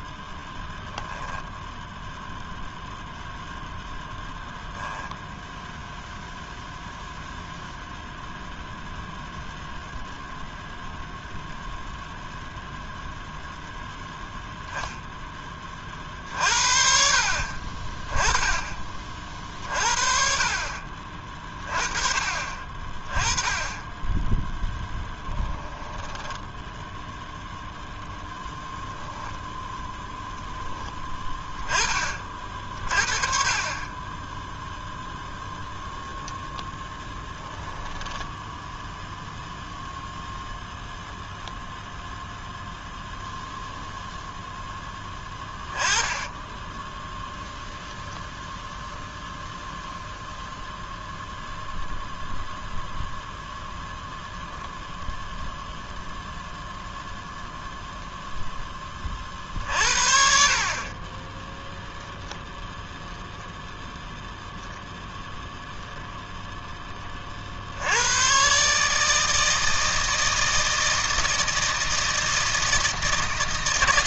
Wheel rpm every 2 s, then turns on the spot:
10, 0, 0, 0, 0, 0, 0, 0, 50, 30, 40, 30, 10, 0, 0, 10, 40, 0, 0, 0, 0, 0, 10, 10, 0, 0, 0, 0, 0, 20, 40, 10, 0, 10, 140, 160, 160.
0-2 24-26 46-48 62-64